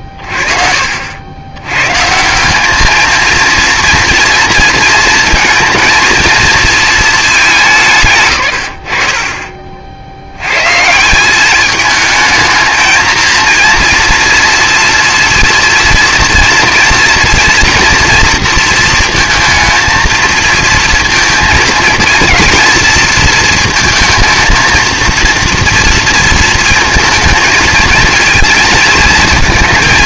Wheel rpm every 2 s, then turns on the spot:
40, 200, 220, 220, 110, 100, 220, 230, 230, 230, 230, 230, 230, 220, 230.
none